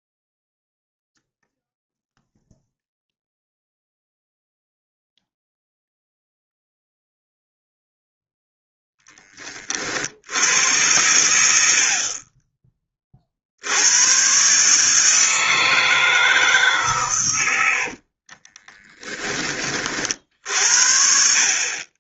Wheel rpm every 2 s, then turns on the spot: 0, 0, 0, 0, 0, 90, 20, 140, 140, 20, 60.
18-20